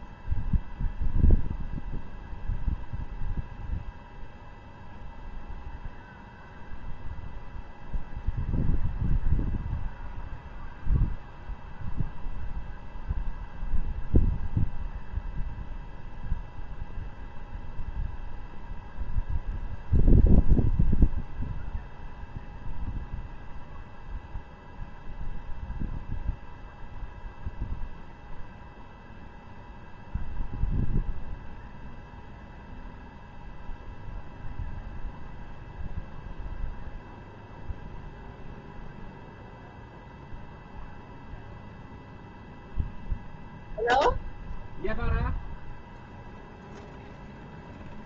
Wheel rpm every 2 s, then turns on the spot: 0, 0, 0, 0, 0, 0, 0, 0, 0, 0, 0, 0, 0, 0, 0, 0, 0, 0, 0, 0, 0, 0, 0, 0.
none